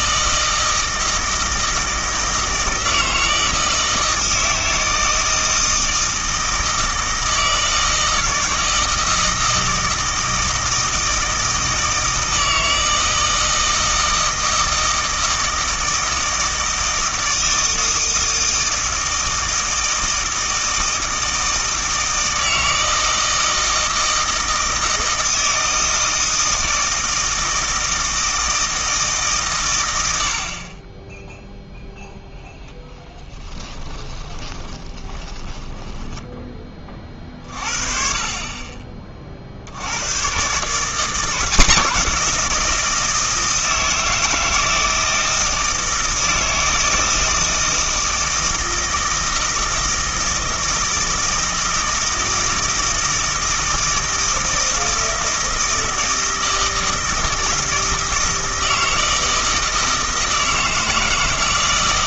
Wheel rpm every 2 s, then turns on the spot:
160, 160, 160, 160, 160, 160, 160, 160, 160, 160, 160, 160, 160, 160, 160, 30, 10, 30, 20, 30, 140, 170, 160, 160, 160, 160, 160, 160, 160, 160, 160.
34-36